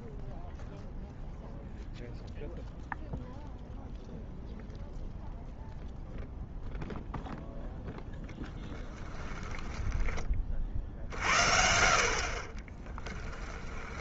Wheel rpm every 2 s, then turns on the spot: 0, 0, 0, 20, 60, 10, 20.
6-8 10-12